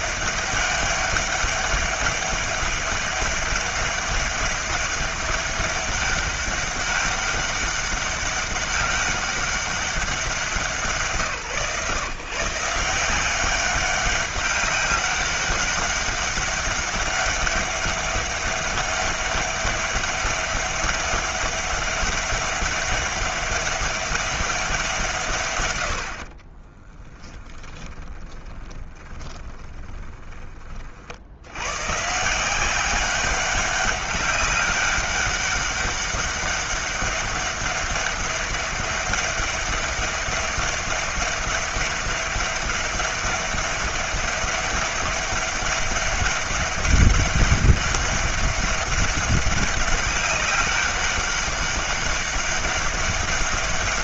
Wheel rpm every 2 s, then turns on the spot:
200, 200, 200, 200, 200, 170, 160, 200, 200, 200, 200, 200, 180, 20, 20, 50, 190, 190, 200, 200, 200, 200, 200, 200, 200, 200, 200.
26-30